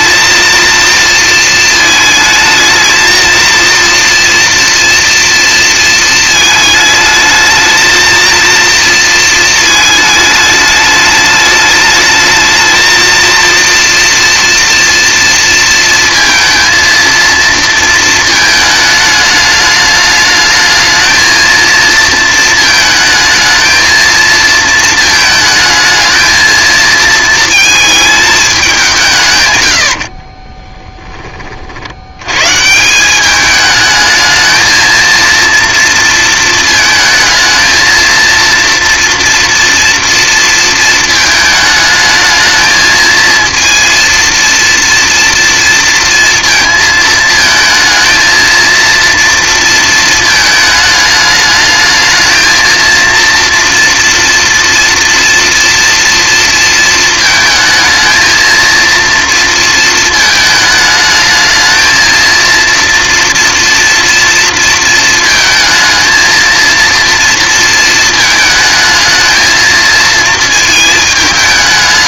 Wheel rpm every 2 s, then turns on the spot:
230, 220, 230, 220, 230, 210, 220, 230, 230, 220, 210, 220, 230, 220, 200, 20, 120, 220, 220, 230, 230, 220, 230, 230, 230, 220, 220, 230, 230, 230, 220, 230, 230, 230, 220, 220.
30-32